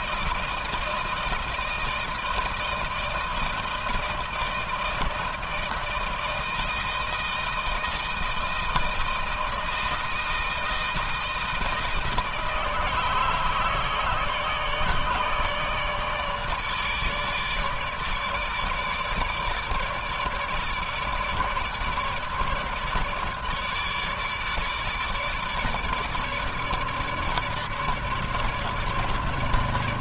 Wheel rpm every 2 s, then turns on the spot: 160, 160, 160, 160, 160, 160, 160, 150, 150, 150, 150, 150, 150, 150, 150.
none